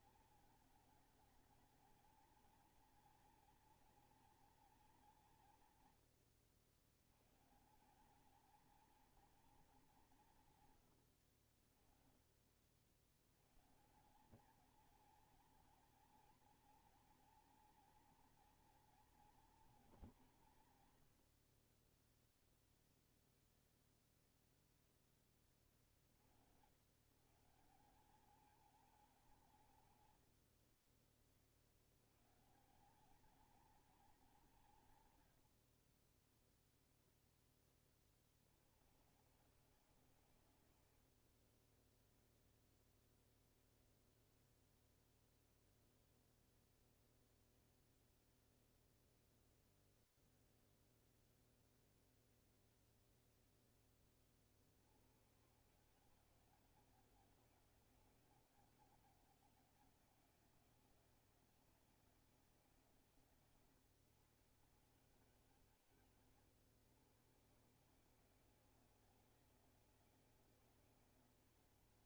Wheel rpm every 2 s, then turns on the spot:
220, 220, 230, 100, 220, 160, 50, 200, 230, 230, 180, 0, 0, 80, 200, 90, 160, 190, 0, 70, 110, 0, 0, 0, 0, 0, 0, 50, 160, 160, 160, 160, 140, 120, 160, 160.
30-32